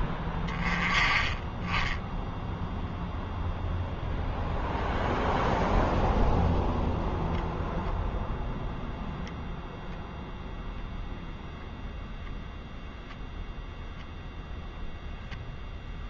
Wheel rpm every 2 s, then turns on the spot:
20, 0, 0, 0, 0, 0, 0, 0.
none